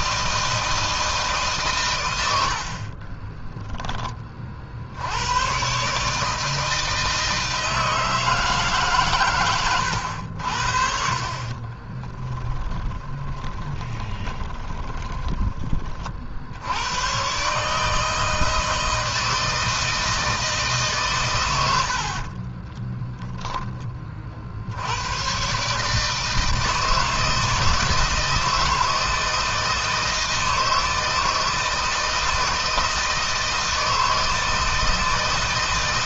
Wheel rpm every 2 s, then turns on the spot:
160, 40, 70, 160, 140, 60, 20, 20, 100, 160, 140, 20, 90, 160, 160, 160, 160, 160.
2-4 12-16 22-24